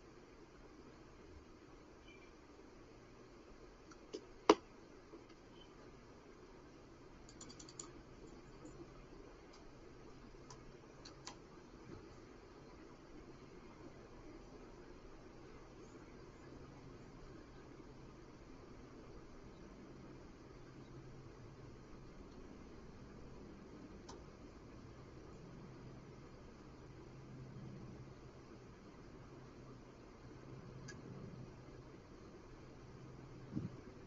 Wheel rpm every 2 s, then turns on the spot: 0, 0, 0, 0, 0, 0, 0, 0, 0, 0, 0, 0, 0, 0, 0, 0, 0.
none